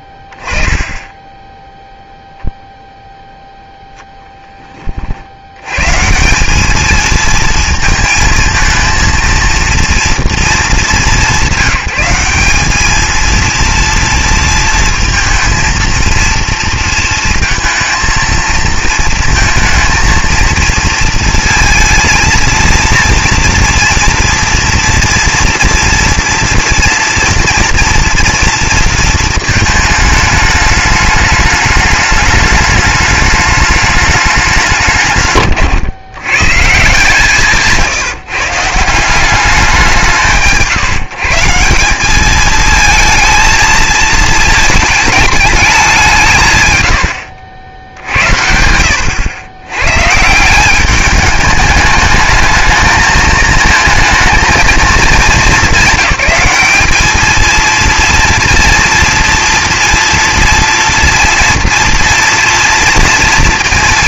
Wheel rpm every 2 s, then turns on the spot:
10, 0, 20, 210, 220, 190, 210, 230, 230, 220, 230, 230, 230, 230, 230, 210, 210, 130, 160, 160, 140, 220, 220, 110, 80, 190, 220, 220, 220, 230, 230, 230.
0-2